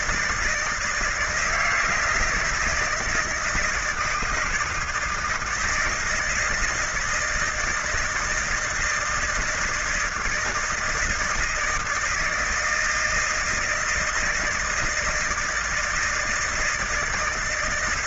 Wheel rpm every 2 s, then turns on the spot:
160, 170, 160, 160, 160, 160, 160, 160, 160.
none